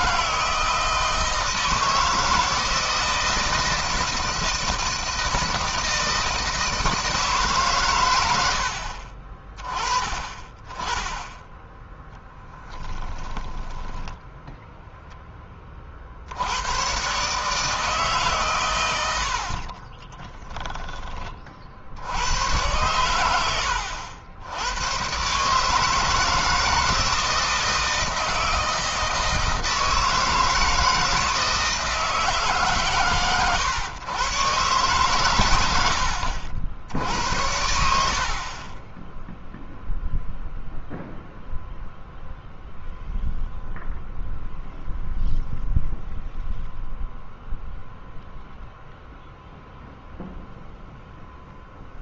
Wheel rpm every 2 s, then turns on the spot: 160, 160, 160, 160, 50, 20, 10, 0, 120, 90, 20, 100, 110, 160, 160, 160, 130, 120, 80, 10, 0, 0, 0, 0, 0, 0.
12-14